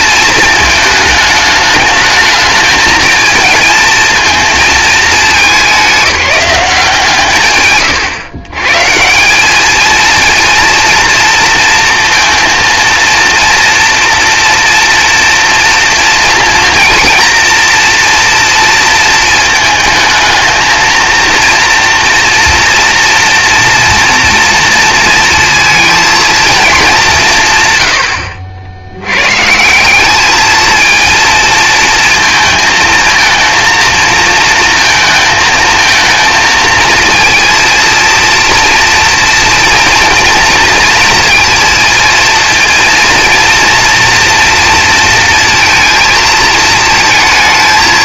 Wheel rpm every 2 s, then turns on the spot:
220, 220, 220, 170, 150, 230, 230, 230, 230, 230, 220, 230, 230, 230, 80, 220, 220, 230, 230, 230, 230, 230, 230, 220.
none